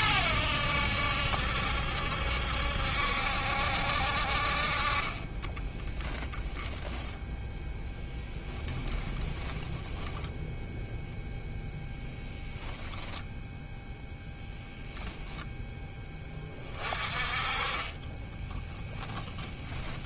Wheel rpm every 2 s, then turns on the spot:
80, 70, 40, 0, 10, 0, 0, 0, 30, 10.
8-10